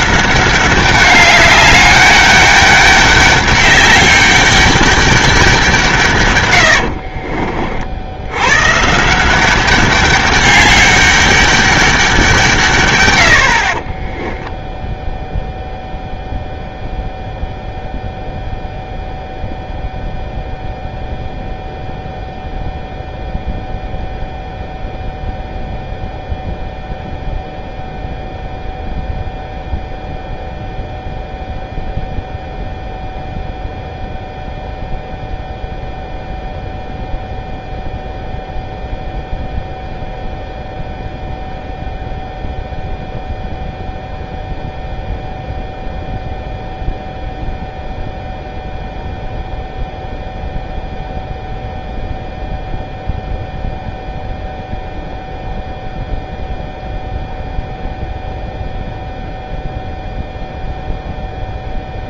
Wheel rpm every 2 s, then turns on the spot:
200, 200, 200, 80, 150, 200, 120, 0, 0, 0, 0, 0, 0, 0, 0, 0, 0, 0, 0, 0, 0, 0, 0, 0, 0, 0, 0, 0, 0, 0, 0.
6-8